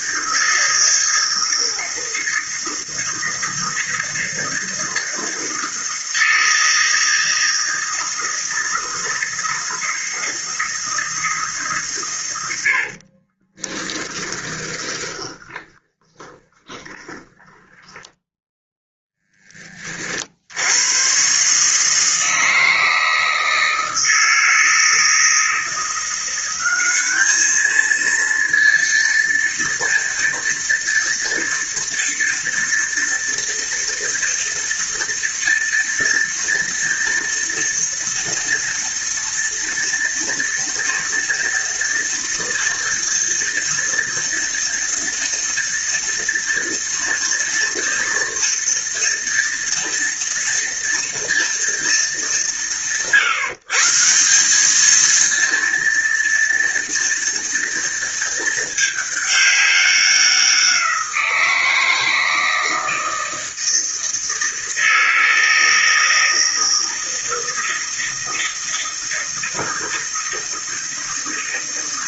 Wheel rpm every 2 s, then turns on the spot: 160, 160, 160, 160, 160, 160, 70, 20, 20, 10, 90, 160, 160, 200, 230, 230, 230, 230, 230, 230, 230, 230, 230, 230, 230, 230, 150, 220, 230, 220, 180, 160, 160, 160, 160, 160.
12-18